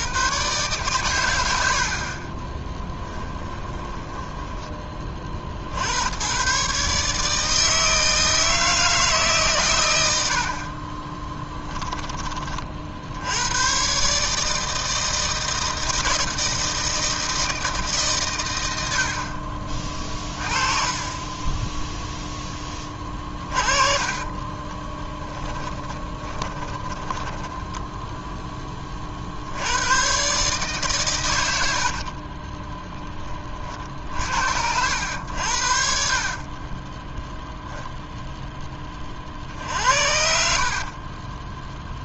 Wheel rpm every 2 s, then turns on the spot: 130, 10, 20, 140, 160, 40, 70, 160, 160, 80, 30, 30, 20, 20, 30, 130, 10, 80, 10, 20, 40.
2-4 10-12 20-28 32-34 36-38 40-42